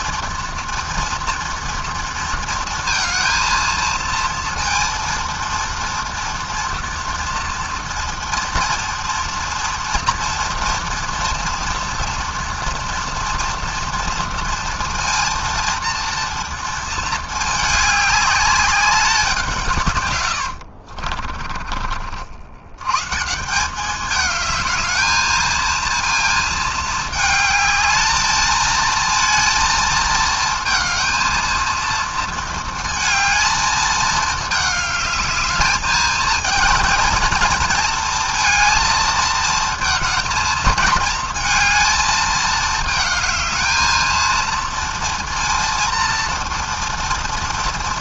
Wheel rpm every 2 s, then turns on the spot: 230, 220, 230, 230, 230, 240, 240, 230, 210, 170, 30, 160, 220, 220, 230, 230, 220, 220, 220, 230, 220, 220, 230, 230.
20-22